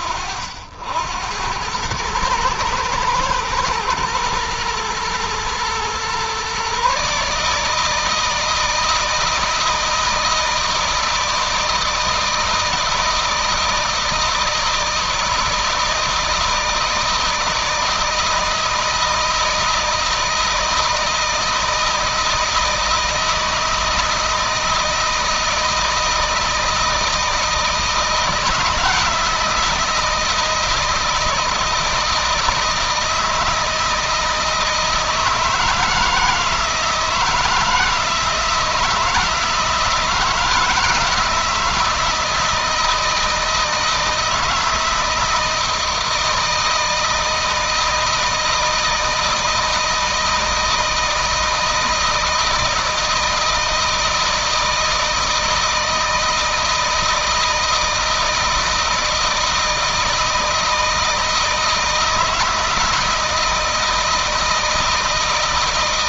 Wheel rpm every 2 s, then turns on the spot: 80, 110, 120, 140, 160, 160, 160, 160, 160, 160, 160, 160, 160, 160, 160, 170, 160, 160, 160, 160, 160, 170, 160, 160, 160, 160, 160, 160, 160, 160, 160, 160, 160.
none